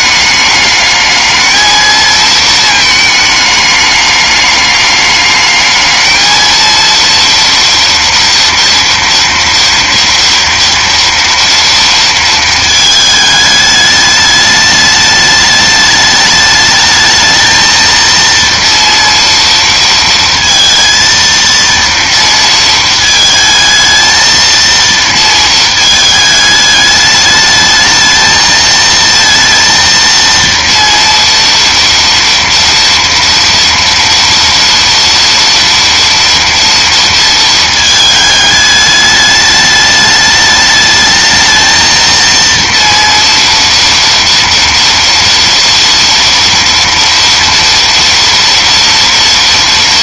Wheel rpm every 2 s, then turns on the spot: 210, 220, 210, 230, 230, 230, 220, 210, 210, 230, 230, 230, 230, 210, 220, 230, 230, 230, 230, 210, 210, 230, 230, 230, 230.
none